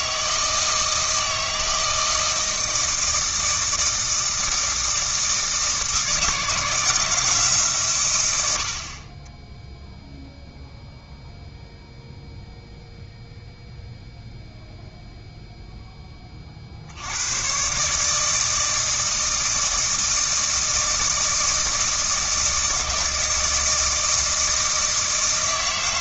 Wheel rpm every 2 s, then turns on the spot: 160, 160, 160, 170, 70, 0, 0, 0, 60, 160, 160, 160, 160.
none